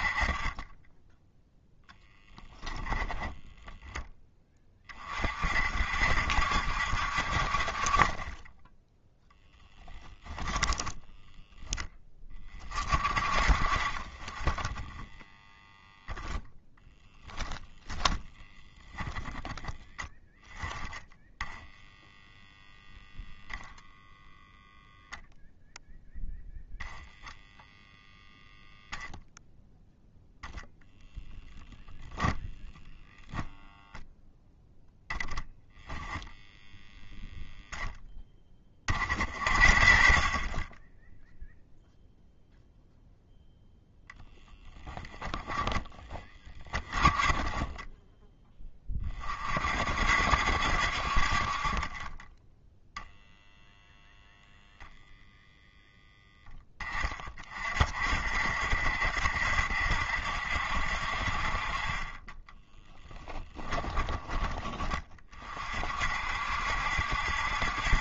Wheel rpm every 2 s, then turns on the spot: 20, 10, 20, 70, 10, 10, 30, 20, 0, 10, 10, 0, 0, 0, 0, 0, 0, 0, 10, 20, 30, 0, 10, 20, 10, 60, 10, 0, 10, 60, 60, 10, 20, 60.
10-12 46-48 52-54